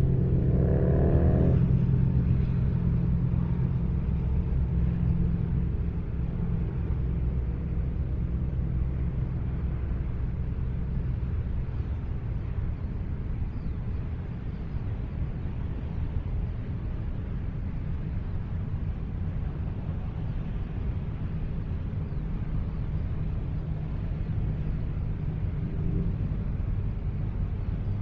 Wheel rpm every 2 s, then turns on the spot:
0, 0, 0, 0, 0, 0, 0, 0, 0, 0, 0, 0, 0, 0.
none